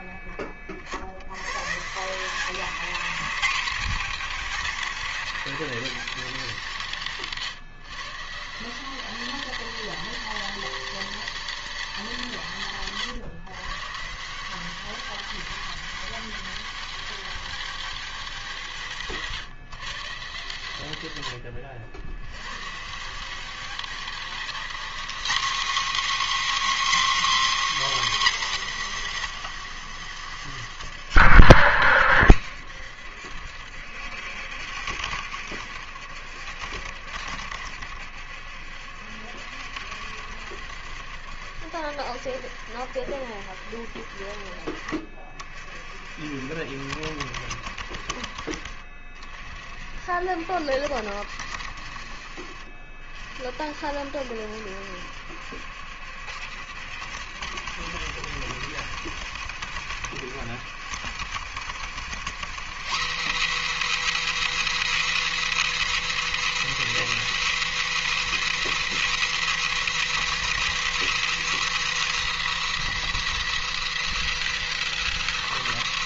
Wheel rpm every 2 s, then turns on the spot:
70, 200, 200, 160, 180, 200, 140, 190, 200, 150, 110, 160, 240, 290, 150, 80, 70, 80, 80, 70, 70, 70, 50, 70, 50, 70, 50, 70, 80, 90, 80, 180, 230, 210, 210, 220, 220, 210.
none